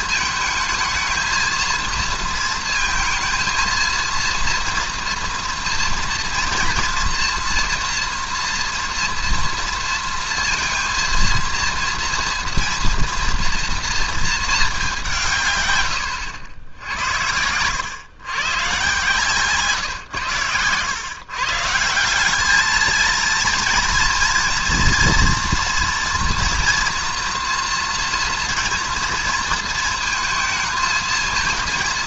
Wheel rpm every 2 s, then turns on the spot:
220, 230, 230, 230, 240, 230, 230, 210, 80, 130, 110, 210, 230, 230, 230, 220.
none